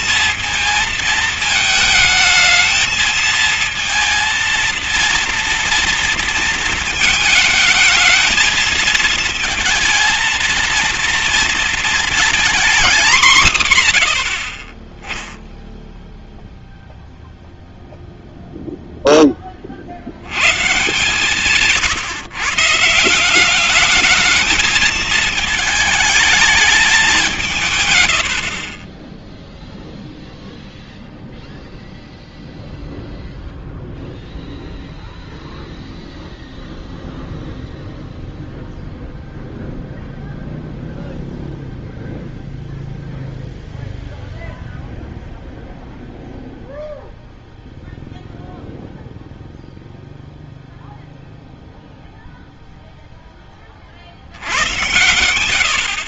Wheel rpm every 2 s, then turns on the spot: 220, 220, 230, 230, 220, 230, 230, 40, 0, 0, 110, 150, 220, 210, 60, 0, 0, 0, 0, 0, 0, 0, 0, 0, 0, 0, 0, 90.
none